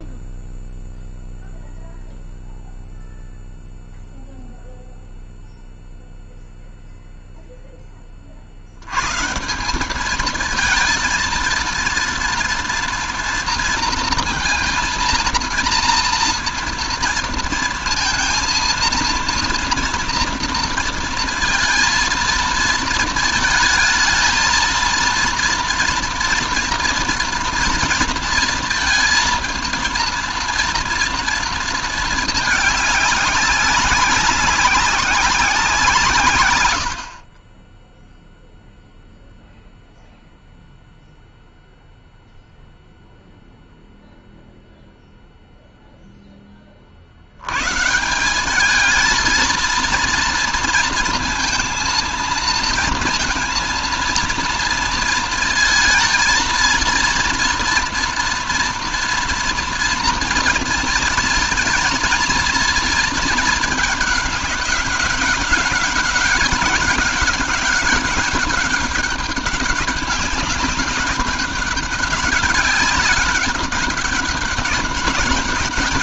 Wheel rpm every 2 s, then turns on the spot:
0, 0, 0, 0, 40, 220, 230, 230, 230, 230, 230, 230, 220, 230, 230, 230, 220, 190, 150, 0, 0, 0, 0, 10, 180, 230, 230, 230, 230, 230, 230, 230, 210, 200, 200, 190, 190, 200.
none